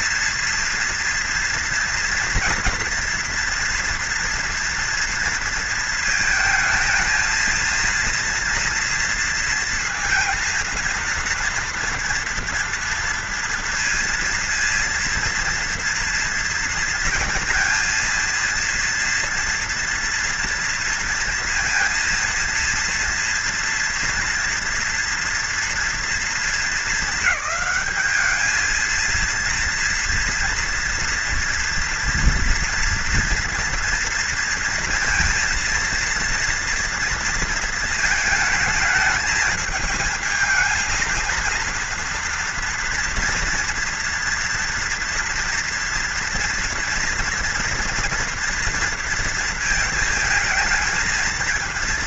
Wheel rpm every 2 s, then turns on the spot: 230, 230, 230, 220, 230, 230, 230, 230, 230, 230, 230, 230, 240, 220, 210, 240, 230, 230, 230, 220, 220, 230, 240, 230, 230, 220.
none